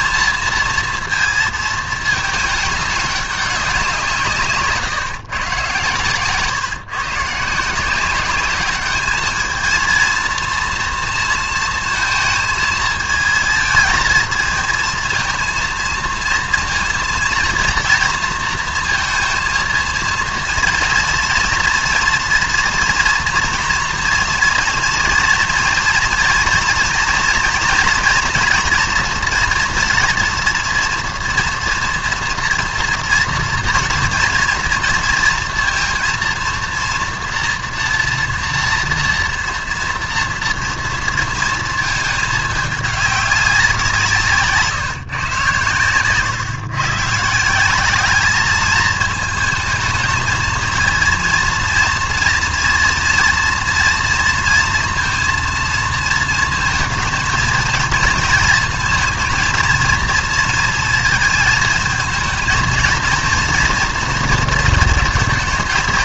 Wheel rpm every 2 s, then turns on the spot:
230, 210, 140, 140, 200, 230, 220, 220, 230, 230, 230, 230, 230, 230, 230, 230, 230, 230, 230, 230, 230, 210, 160, 130, 210, 220, 230, 230, 230, 230, 220, 230, 230.
none